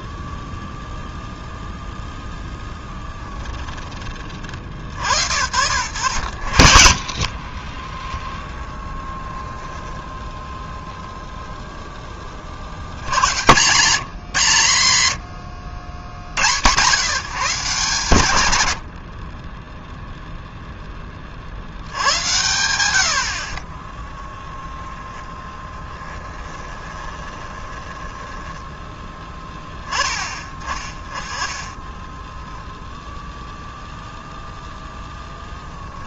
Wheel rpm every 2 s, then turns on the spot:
0, 10, 60, 50, 10, 0, 80, 120, 130, 70, 10, 80, 10, 20, 10, 20, 0, 0.
2-4 24-28